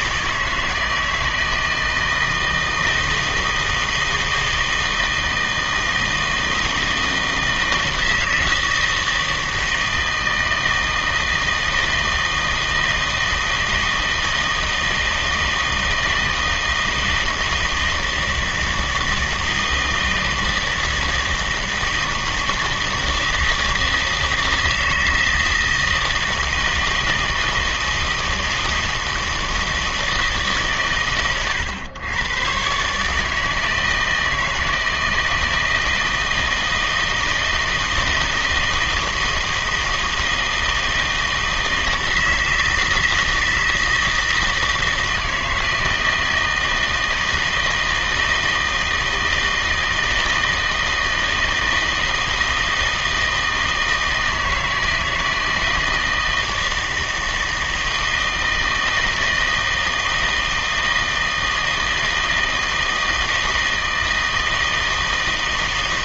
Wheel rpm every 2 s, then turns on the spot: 160, 160, 160, 160, 160, 160, 160, 160, 160, 160, 160, 160, 160, 160, 160, 140, 130, 160, 160, 160, 160, 160, 160, 160, 160, 160, 160, 160, 160, 160, 160, 160, 160.
none